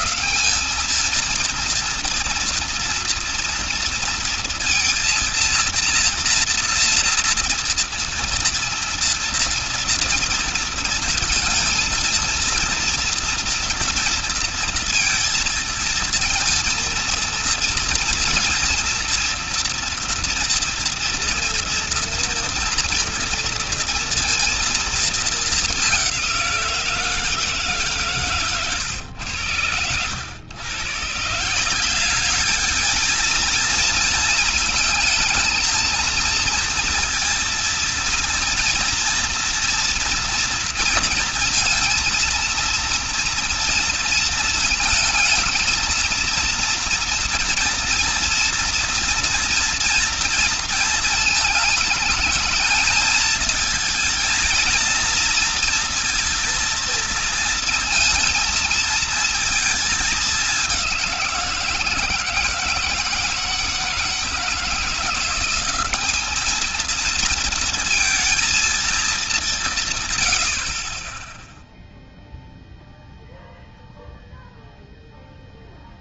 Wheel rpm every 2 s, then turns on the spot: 220, 230, 230, 230, 230, 230, 230, 230, 230, 230, 230, 230, 230, 170, 110, 130, 220, 230, 230, 230, 230, 230, 220, 230, 230, 230, 220, 230, 230, 220, 190, 160, 170, 220, 220, 30, 0, 0.
none